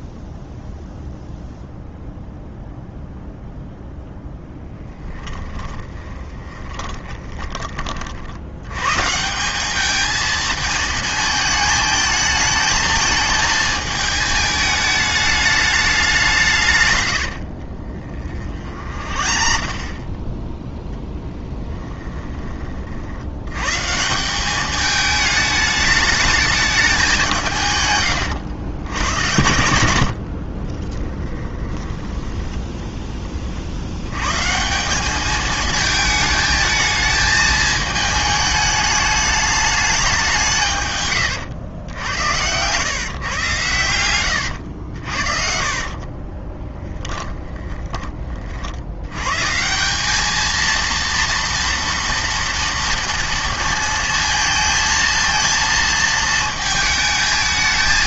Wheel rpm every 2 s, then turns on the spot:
0, 0, 10, 20, 110, 220, 220, 220, 140, 40, 10, 40, 210, 210, 100, 40, 10, 160, 220, 210, 150, 110, 80, 10, 70, 230, 240, 230, 220.
4-8 18-20 30-32 46-48